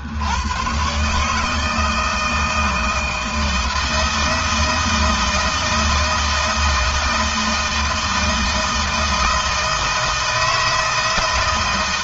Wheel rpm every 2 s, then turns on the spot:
130, 160, 160, 170, 160, 160.
none